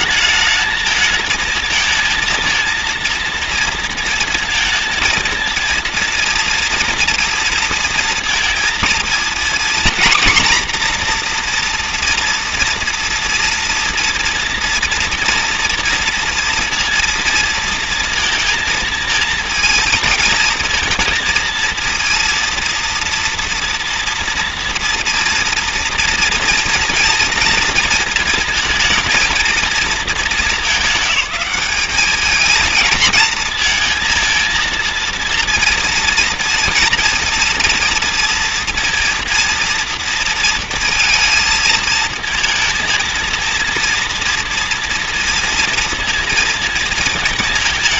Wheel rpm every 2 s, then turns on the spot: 220, 230, 230, 230, 230, 240, 230, 230, 230, 230, 230, 230, 240, 230, 220, 210, 220, 230, 230, 230, 230, 230, 230, 230.
none